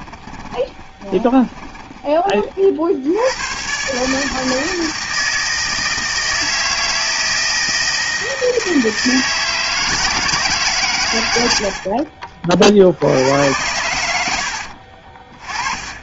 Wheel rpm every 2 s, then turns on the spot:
20, 50, 160, 160, 160, 140, 60, 60.
0-2 14-16